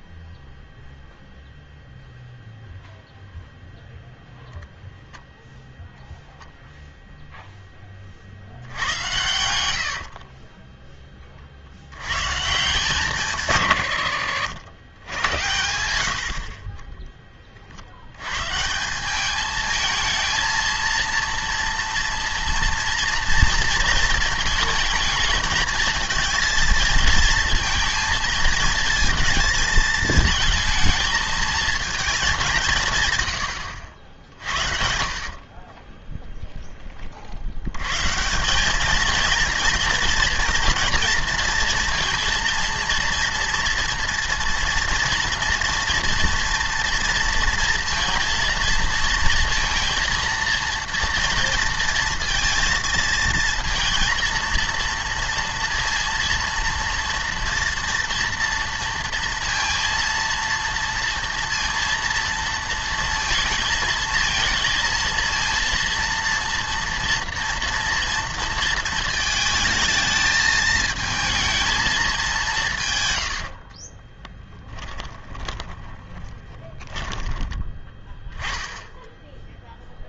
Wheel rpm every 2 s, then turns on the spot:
0, 0, 0, 0, 90, 10, 160, 80, 30, 160, 230, 230, 220, 220, 230, 220, 160, 60, 10, 200, 230, 230, 230, 230, 230, 230, 230, 230, 230, 240, 230, 230, 230, 230, 230, 220, 170, 20, 30, 10.
8-10 34-36 74-78